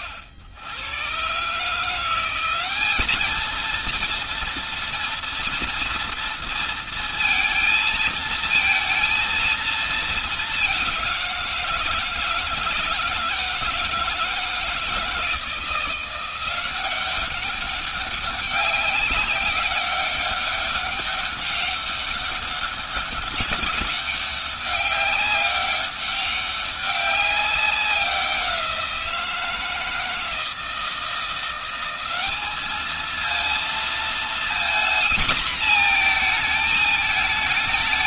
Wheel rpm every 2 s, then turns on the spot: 80, 190, 230, 230, 230, 210, 160, 160, 180, 200, 200, 200, 200, 200, 180, 160, 210, 230, 220.
none